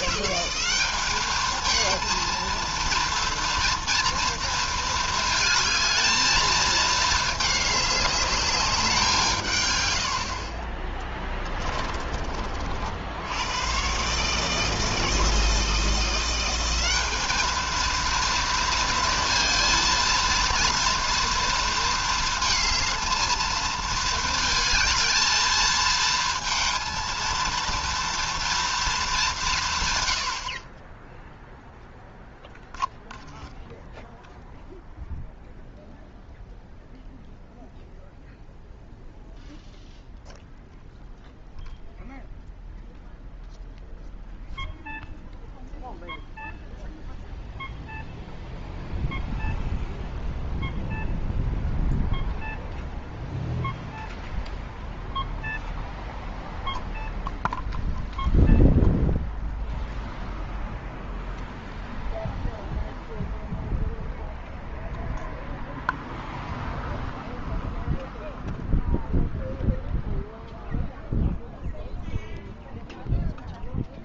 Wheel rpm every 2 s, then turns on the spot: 190, 230, 230, 220, 200, 30, 50, 160, 180, 230, 230, 220, 220, 230, 230, 50, 0, 0, 0, 0, 0, 0, 0, 0, 0, 0, 0, 0, 0, 0, 0, 0, 0, 0, 0, 0, 0.
none